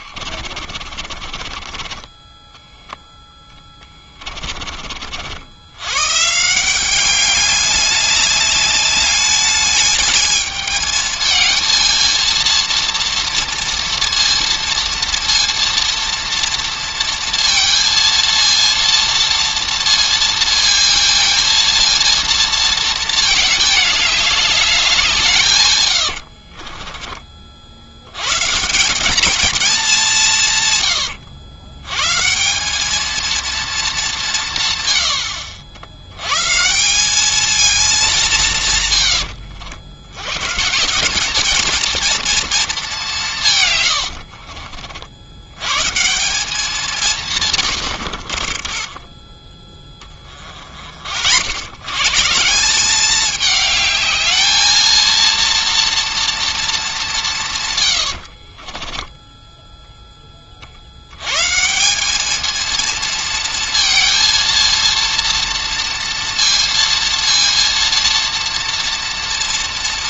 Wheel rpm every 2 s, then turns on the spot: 40, 10, 30, 170, 210, 220, 230, 230, 230, 230, 230, 230, 200, 40, 150, 140, 180, 140, 150, 150, 130, 220, 50, 190, 40, 40, 170, 220, 230, 50, 40, 220, 230, 230, 230.
0-4 26-28 44-46 48-50 58-60